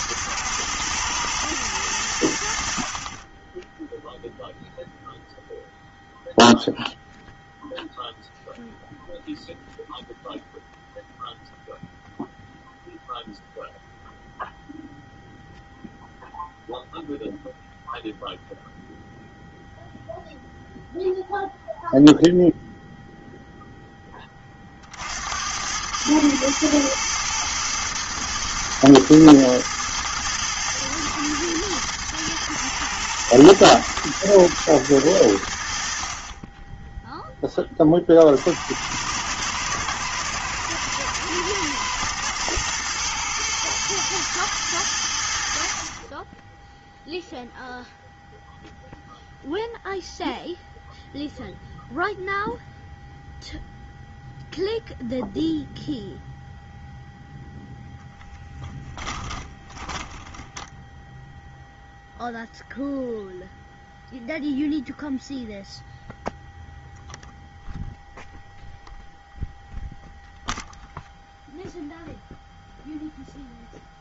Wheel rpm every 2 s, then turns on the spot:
120, 50, 0, 0, 0, 0, 0, 0, 0, 0, 0, 0, 50, 110, 110, 110, 120, 110, 10, 90, 110, 120, 90, 0, 0, 0, 0, 0, 0, 10, 0, 0, 0, 0, 0, 0, 0.
58-60